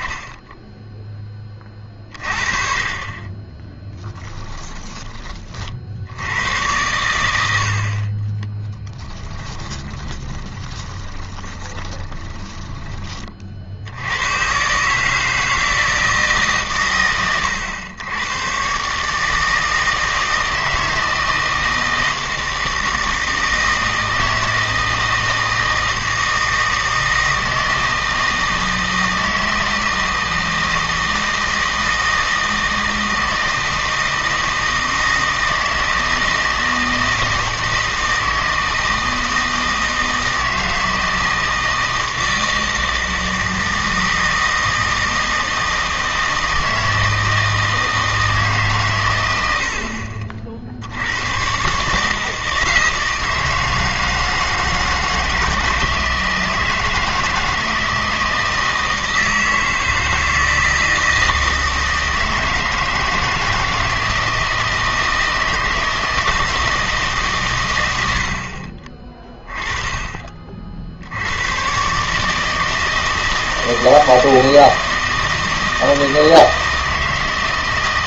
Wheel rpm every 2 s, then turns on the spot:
10, 30, 10, 100, 10, 20, 20, 140, 130, 130, 160, 160, 160, 160, 160, 160, 160, 160, 160, 160, 160, 160, 160, 160, 130, 70, 160, 160, 160, 160, 160, 160, 160, 160, 30, 50, 160, 160, 160.
4-6 8-14